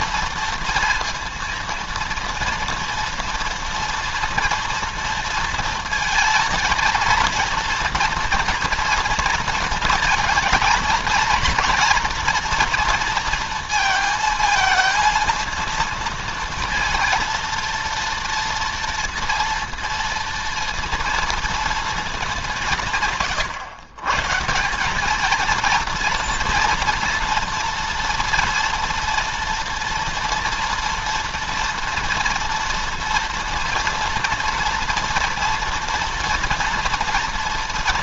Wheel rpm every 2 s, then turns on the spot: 230, 230, 230, 230, 240, 220, 230, 230, 230, 230, 230, 170, 180, 230, 230, 230, 230, 230, 230.
none